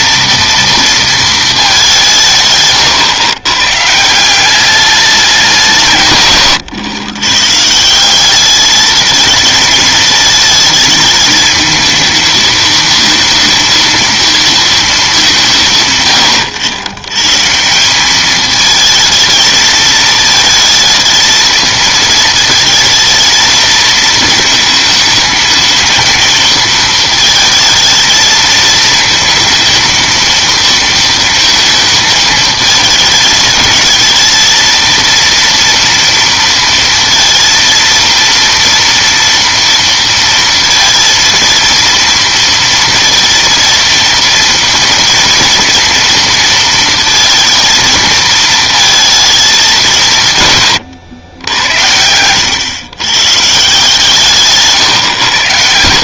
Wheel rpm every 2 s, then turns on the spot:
230, 130, 200, 120, 220, 220, 230, 220, 110, 220, 220, 220, 220, 230, 220, 230, 220, 230, 230, 230, 230, 230, 230, 230, 220, 110, 110, 130.
none